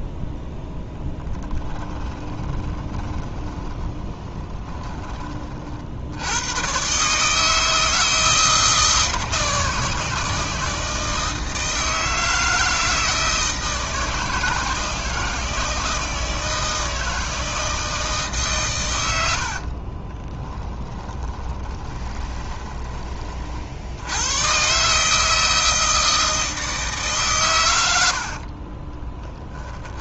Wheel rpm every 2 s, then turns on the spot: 0, 20, 20, 120, 160, 160, 160, 160, 160, 130, 10, 20, 140, 150, 30.
2-6 20-22 28-30